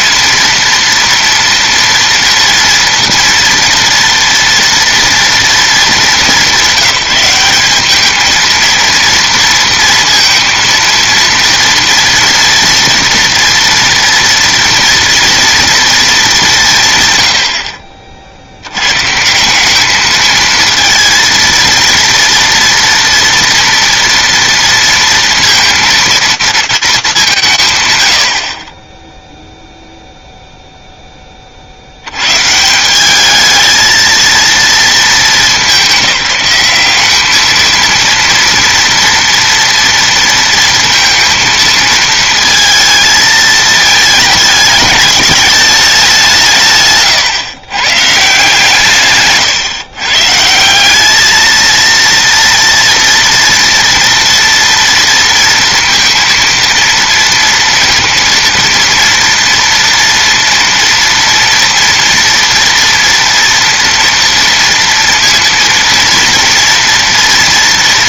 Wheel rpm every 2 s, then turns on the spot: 230, 230, 230, 200, 220, 230, 230, 230, 200, 60, 220, 230, 230, 230, 30, 0, 130, 220, 190, 230, 230, 230, 220, 170, 150, 160, 230, 230, 230, 230, 230, 240, 230, 230.
none